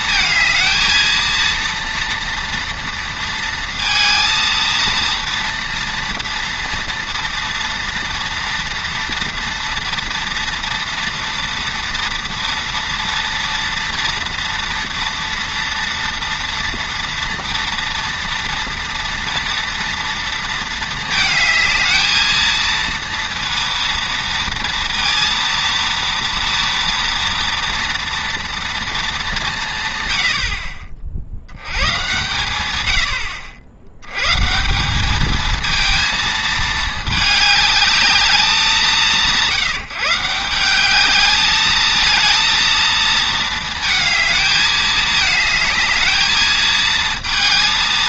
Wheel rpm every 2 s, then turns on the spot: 220, 230, 230, 230, 230, 230, 230, 230, 230, 230, 230, 230, 230, 230, 230, 60, 100, 160, 220, 190, 180, 230, 220, 220.
none